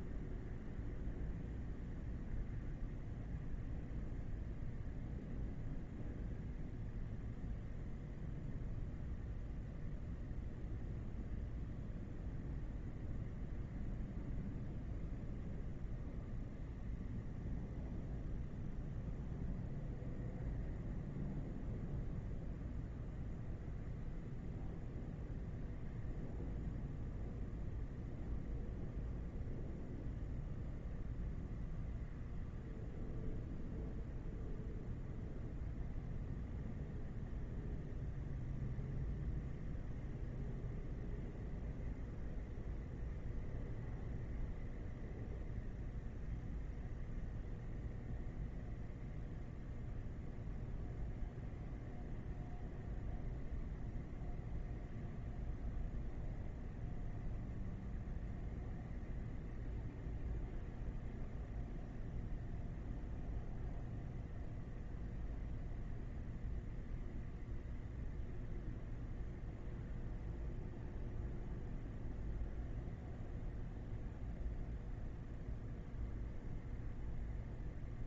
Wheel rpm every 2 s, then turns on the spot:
0, 0, 0, 0, 0, 0, 0, 0, 0, 0, 0, 0, 0, 0, 0, 0, 0, 0, 0, 0, 0, 0, 0, 0, 0, 0, 0, 0, 0, 0, 0, 0, 0, 0, 0, 0, 0, 0, 0.
none